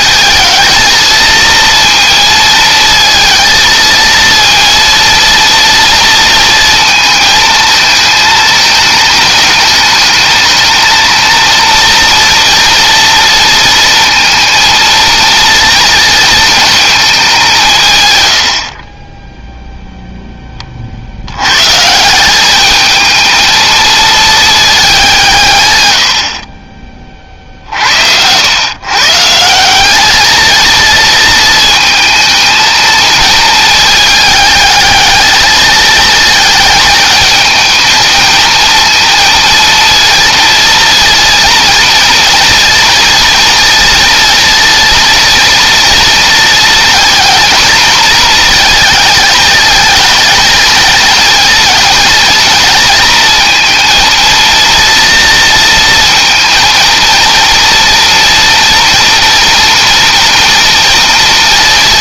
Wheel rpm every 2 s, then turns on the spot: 220, 230, 230, 230, 210, 220, 230, 230, 210, 20, 70, 220, 190, 40, 140, 220, 220, 210, 220, 230, 230, 230, 230, 230, 220, 220, 230, 230, 230, 230, 230.
none